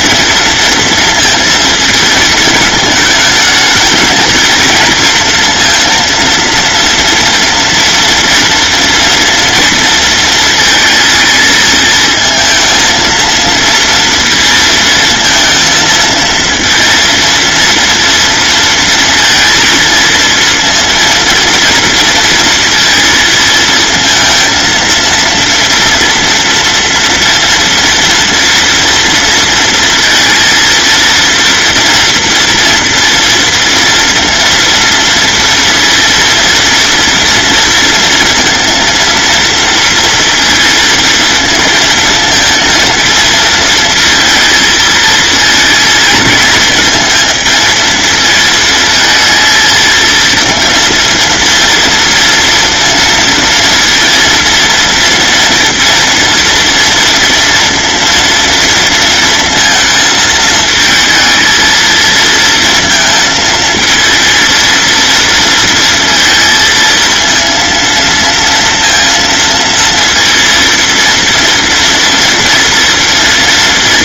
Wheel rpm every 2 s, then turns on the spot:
230, 220, 230, 230, 240, 220, 220, 230, 230, 230, 230, 230, 230, 230, 230, 230, 230, 230, 230, 230, 230, 230, 230, 230, 220, 230, 230, 240, 230, 230, 220, 230, 230, 230, 230, 230, 230.
none